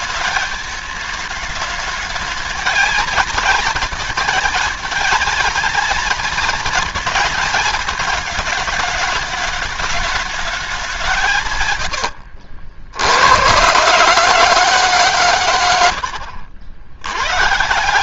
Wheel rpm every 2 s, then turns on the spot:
210, 220, 230, 230, 220, 190, 80, 140, 100.
none